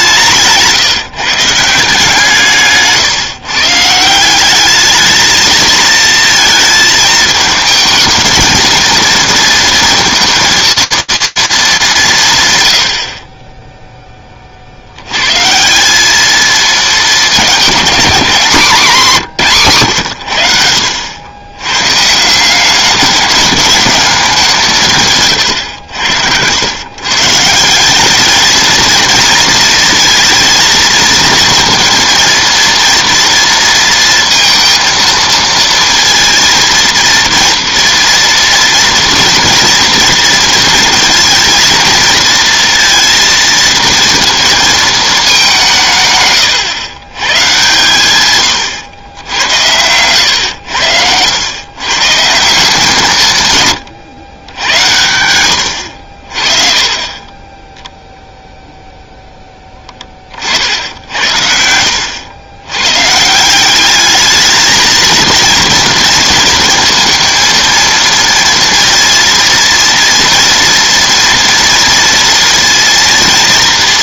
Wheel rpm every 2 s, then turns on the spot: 160, 150, 200, 230, 230, 230, 100, 40, 220, 200, 90, 190, 180, 110, 220, 230, 230, 230, 230, 230, 230, 230, 230, 130, 120, 100, 170, 90, 30, 0, 60, 110, 220, 230, 230, 230, 230.
56-58